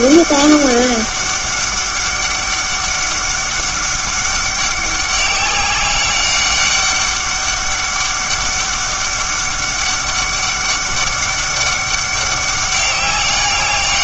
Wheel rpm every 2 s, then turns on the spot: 200, 200, 200, 200, 200, 200, 200.
none